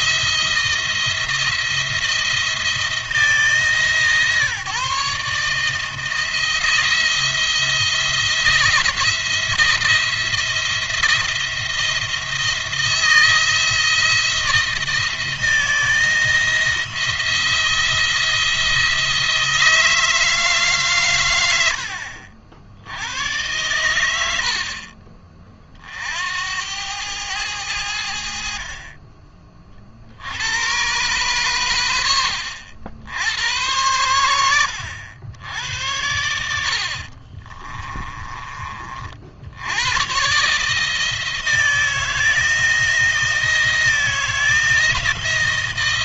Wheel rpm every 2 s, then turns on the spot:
160, 170, 140, 170, 160, 170, 160, 160, 170, 170, 150, 80, 60, 80, 50, 100, 80, 90, 60, 30, 140, 160, 160.
36-38